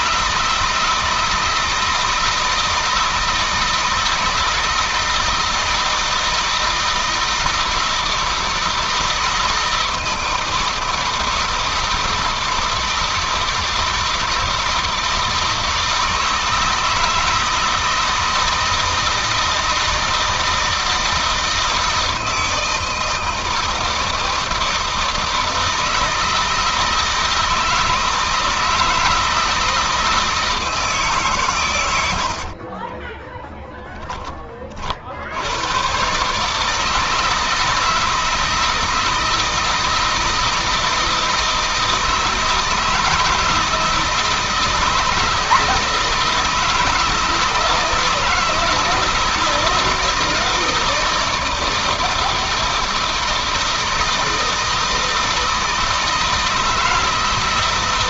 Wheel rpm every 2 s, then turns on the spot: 160, 160, 160, 160, 160, 160, 160, 160, 160, 160, 160, 160, 160, 160, 160, 150, 30, 50, 150, 160, 160, 160, 160, 160, 160, 160, 160, 160, 160.
32-34